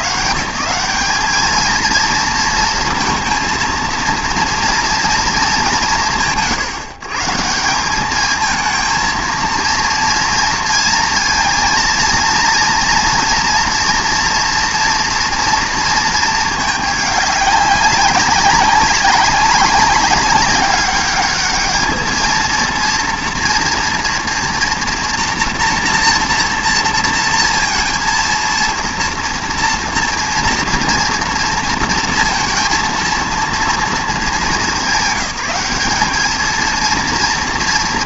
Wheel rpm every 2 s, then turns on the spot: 180, 230, 230, 130, 220, 230, 230, 230, 210, 190, 200, 230, 230, 230, 230, 240, 230, 190, 230.
none